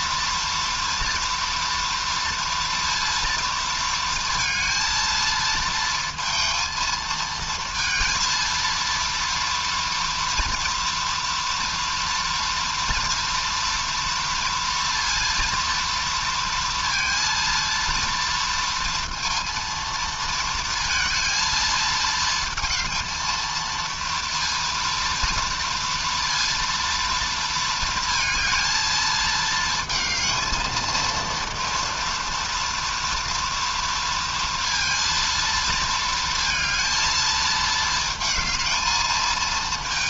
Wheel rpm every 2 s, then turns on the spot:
230, 230, 230, 220, 230, 230, 230, 230, 230, 230, 230, 220, 230, 230, 220, 220, 230, 230, 230, 220.
none